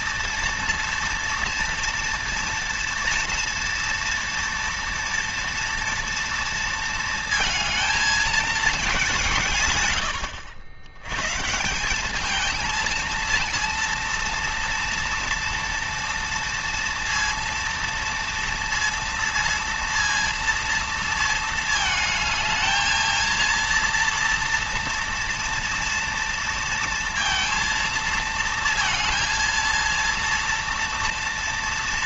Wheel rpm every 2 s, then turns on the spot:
230, 230, 230, 230, 190, 110, 220, 230, 230, 230, 230, 220, 230, 230, 230, 230.
none